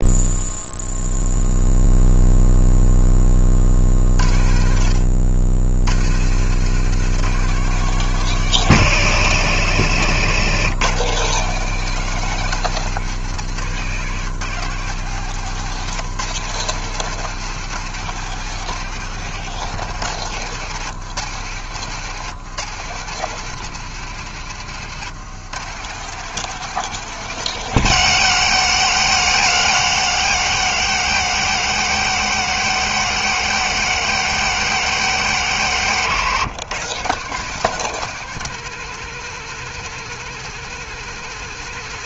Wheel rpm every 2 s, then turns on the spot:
0, 0, 60, 120, 160, 130, 170, 150, 150, 170, 150, 140, 140, 170, 140, 130, 140, 140, 130, 170, 160.
none